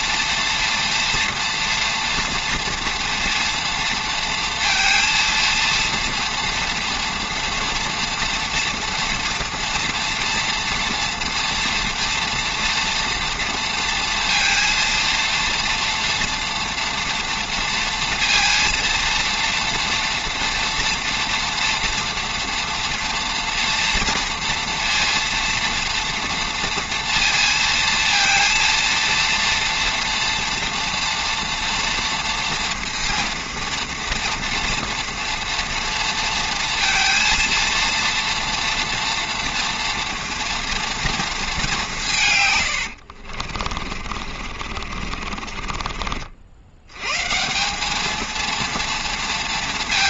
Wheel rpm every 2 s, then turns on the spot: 230, 240, 230, 230, 230, 230, 230, 230, 230, 230, 230, 240, 230, 230, 230, 230, 230, 230, 230, 240, 230, 60, 50, 130, 230.
42-46